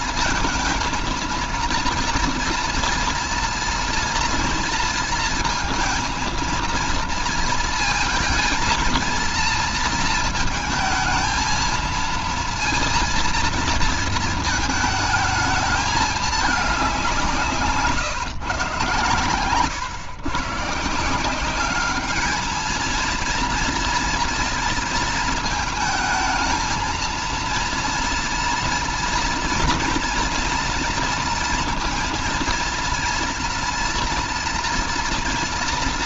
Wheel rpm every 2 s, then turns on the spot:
230, 230, 230, 230, 230, 220, 230, 220, 190, 130, 150, 220, 230, 220, 240, 230, 230, 230.
none